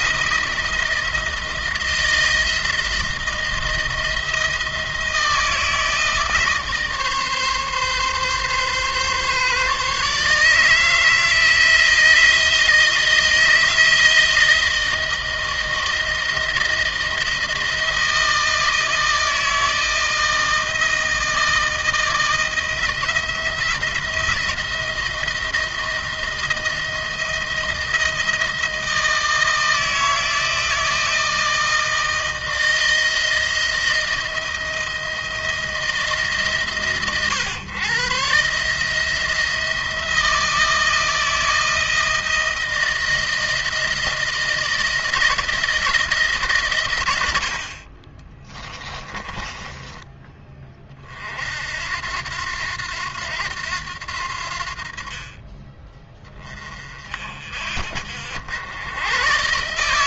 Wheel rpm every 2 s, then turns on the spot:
170, 170, 160, 150, 140, 160, 170, 170, 160, 160, 160, 170, 170, 160, 160, 160, 160, 160, 120, 160, 160, 160, 160, 100, 20, 40, 90, 50, 40, 110.
48-50